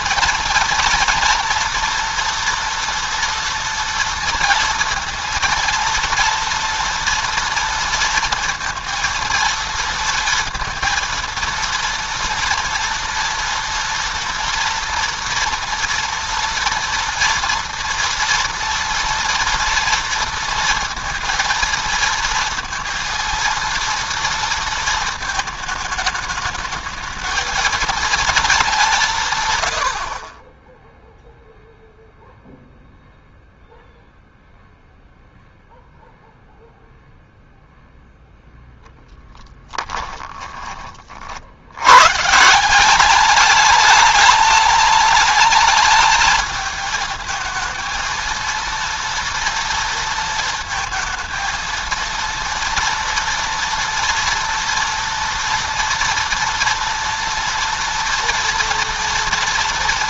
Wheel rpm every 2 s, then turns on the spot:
230, 230, 230, 230, 230, 230, 230, 240, 230, 230, 230, 230, 230, 220, 190, 10, 0, 0, 0, 0, 30, 180, 220, 220, 230, 220, 230, 230, 230, 230.
none